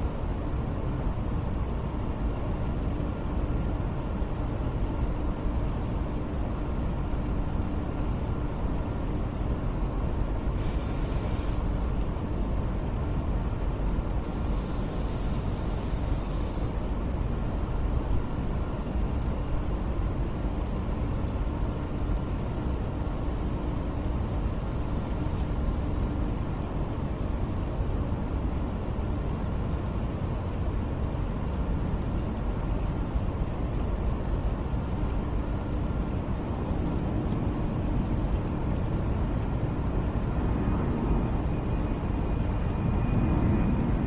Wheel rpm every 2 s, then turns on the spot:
0, 0, 0, 0, 0, 0, 0, 0, 0, 0, 0, 0, 0, 0, 0, 0, 0, 0, 0, 0, 0, 0.
none